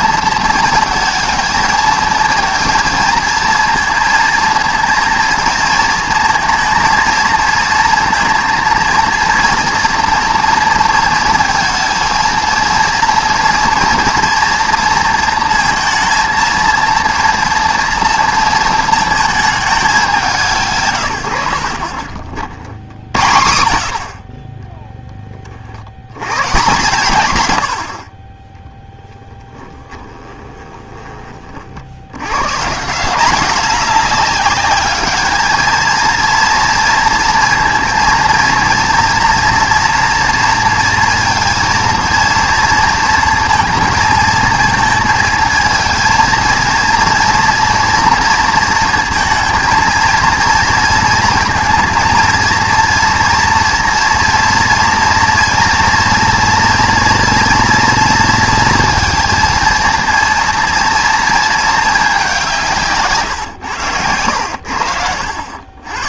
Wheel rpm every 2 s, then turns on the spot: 230, 230, 230, 230, 230, 230, 230, 230, 230, 230, 150, 70, 20, 150, 20, 20, 150, 210, 230, 230, 230, 230, 220, 230, 230, 230, 240, 230, 230, 230, 230, 180, 80.
30-32